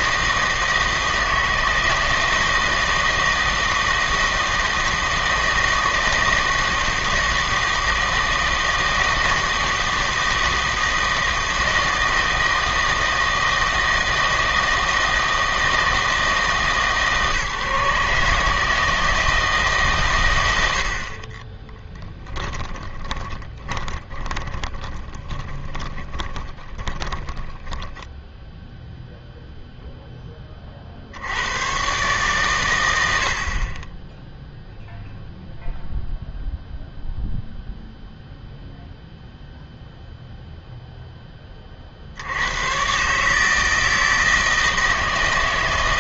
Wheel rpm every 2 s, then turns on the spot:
160, 160, 160, 160, 160, 160, 160, 160, 150, 160, 70, 10, 20, 20, 0, 30, 110, 0, 0, 0, 0, 120, 160.
22-28